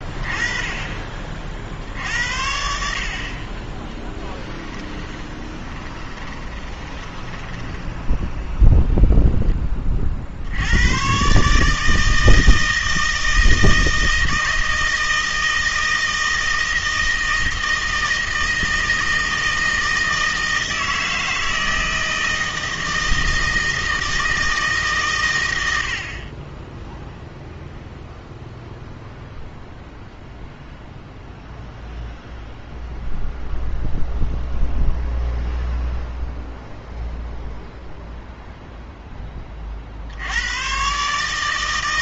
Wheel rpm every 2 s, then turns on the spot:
30, 70, 10, 20, 0, 80, 160, 160, 160, 160, 160, 160, 150, 10, 0, 0, 0, 0, 0, 0, 110.
2-8